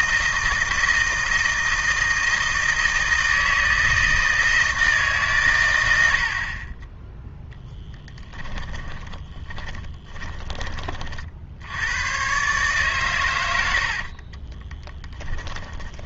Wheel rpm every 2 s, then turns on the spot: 160, 160, 160, 30, 20, 20, 140, 20.
8-10 14-16